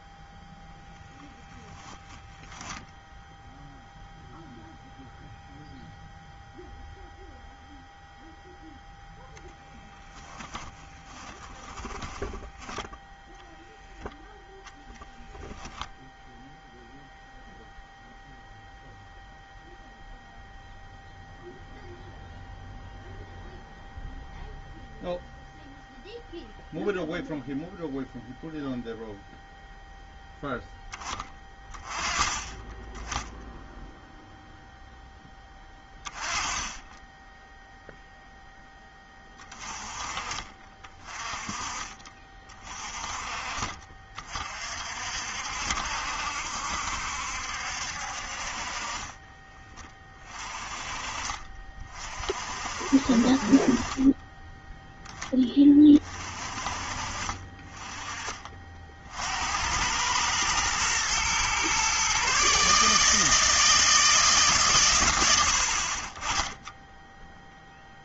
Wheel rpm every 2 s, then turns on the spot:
10, 10, 0, 0, 0, 20, 0, 0, 0, 0, 0, 0, 0, 0, 0, 10, 10, 0, 20, 10, 30, 40, 50, 70, 40, 30, 50, 10, 40, 50, 120, 150, 120, 10.
10-12 48-52